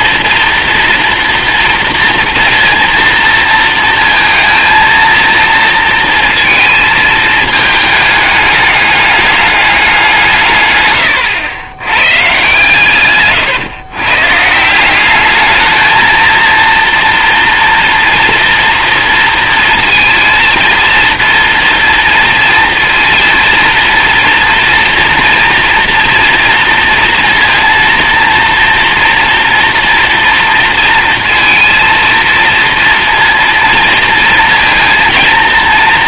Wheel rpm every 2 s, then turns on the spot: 230, 230, 230, 220, 210, 120, 120, 170, 230, 230, 230, 230, 240, 230, 240, 230, 230, 230.
none